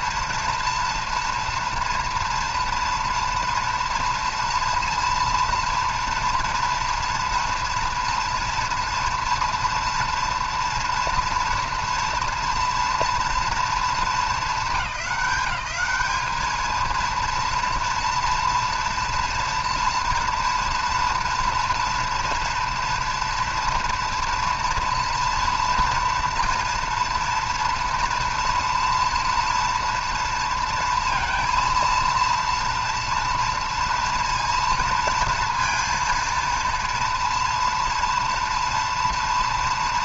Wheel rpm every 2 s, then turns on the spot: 230, 230, 230, 230, 230, 240, 230, 200, 220, 230, 230, 230, 230, 230, 240, 230, 230, 230, 230, 230.
none